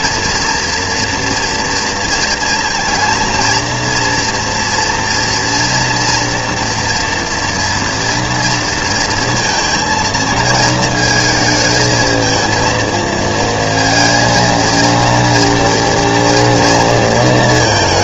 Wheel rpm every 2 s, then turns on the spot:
240, 230, 230, 230, 230, 220, 230, 230, 230.
none